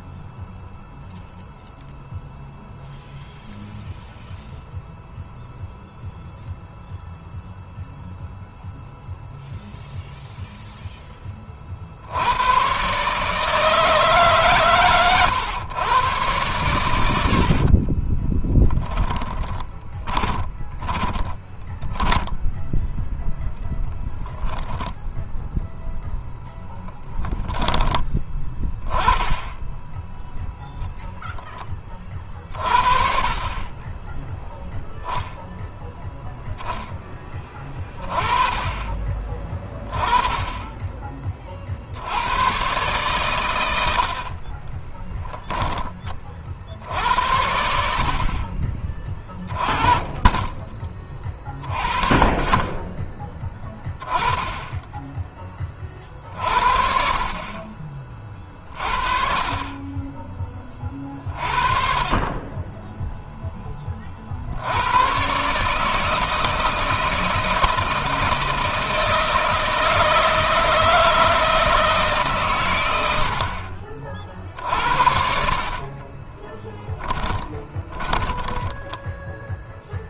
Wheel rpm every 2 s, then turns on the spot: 0, 0, 0, 0, 0, 10, 130, 130, 100, 10, 20, 0, 0, 0, 10, 0, 60, 10, 10, 30, 20, 130, 20, 60, 30, 30, 20, 20, 50, 40, 20, 10, 110, 160, 160, 160, 100, 70, 10, 10.
18-22 44-46 74-80